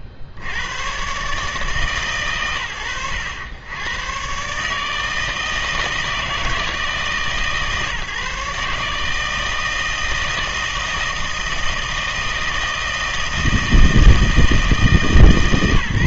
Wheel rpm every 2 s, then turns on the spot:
50, 70, 150, 150, 150, 160, 160, 160.
none